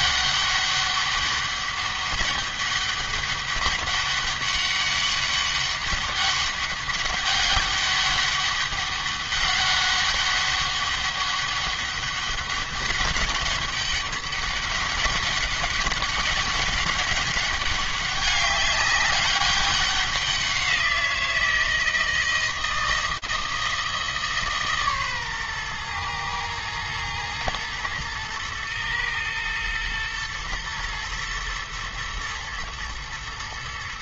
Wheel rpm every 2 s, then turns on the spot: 200, 200, 200, 200, 200, 200, 200, 200, 200, 200, 170, 160, 120, 110, 120, 110, 110.
none